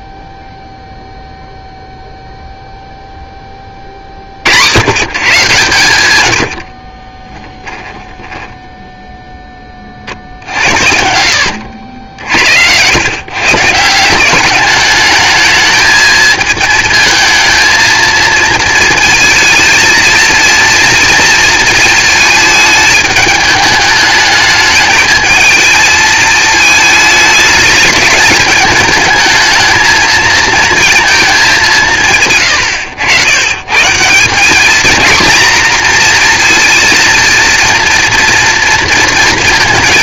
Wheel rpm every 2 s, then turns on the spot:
0, 0, 100, 60, 0, 60, 100, 200, 220, 220, 230, 210, 220, 220, 210, 230, 110, 220, 230, 230.
6-8